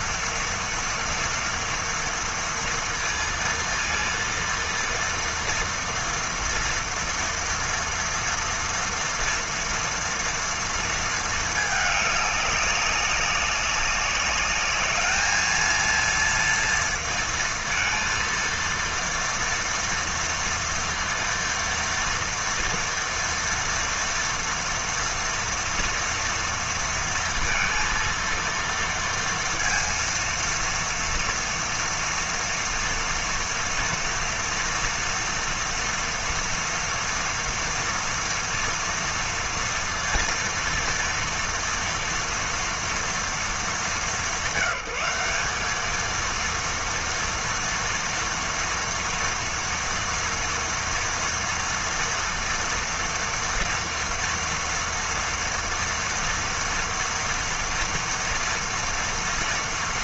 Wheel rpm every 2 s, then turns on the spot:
230, 230, 230, 240, 230, 230, 200, 210, 230, 230, 230, 230, 240, 230, 230, 230, 230, 230, 230, 230, 230, 240, 190, 230, 230, 230, 230, 240, 230, 230.
none